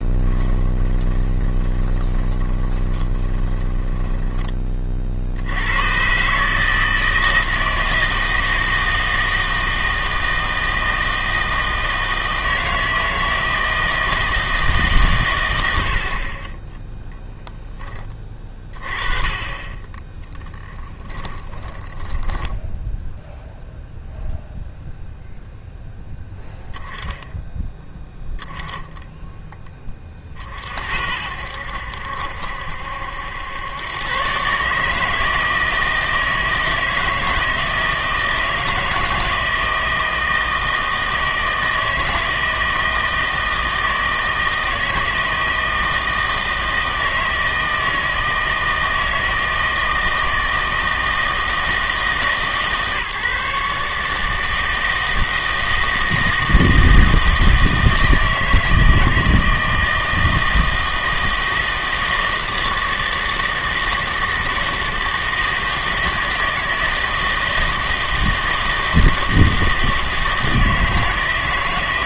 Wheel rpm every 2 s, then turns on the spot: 10, 20, 20, 150, 160, 160, 160, 160, 10, 20, 10, 10, 0, 10, 10, 50, 70, 140, 160, 160, 160, 160, 160, 160, 160, 160, 150, 160, 160, 160, 160, 160, 160, 160, 160, 160.
0-4 20-24